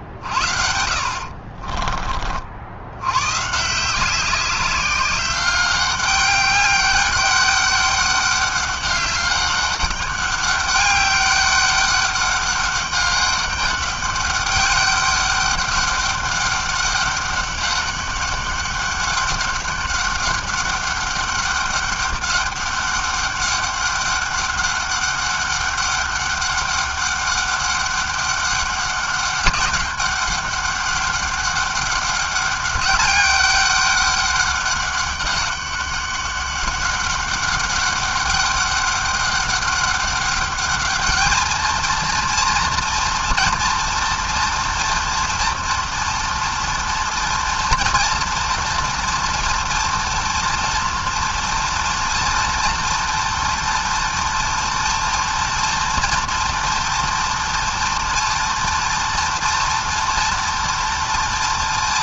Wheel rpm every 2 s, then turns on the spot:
60, 50, 190, 200, 200, 200, 200, 200, 200, 200, 200, 200, 200, 200, 200, 200, 200, 200, 200, 200, 200, 230, 230, 230, 240, 230, 230, 240, 230, 230, 230.
none